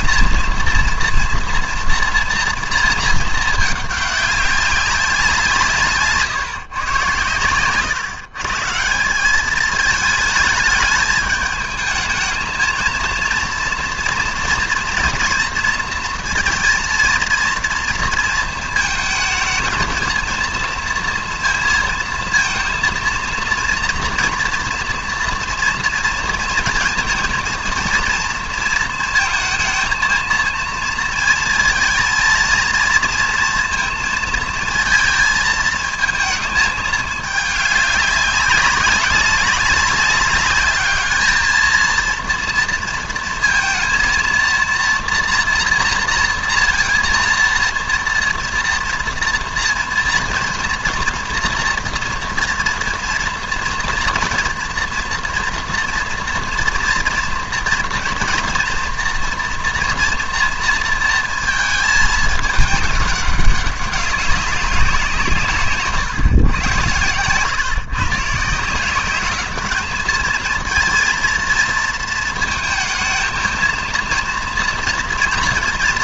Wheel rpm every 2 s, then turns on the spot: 230, 230, 190, 120, 150, 210, 220, 240, 230, 220, 230, 230, 230, 230, 230, 230, 230, 220, 220, 200, 210, 230, 230, 230, 240, 230, 230, 230, 230, 230, 230, 210, 190, 120, 170, 230, 220, 230.
none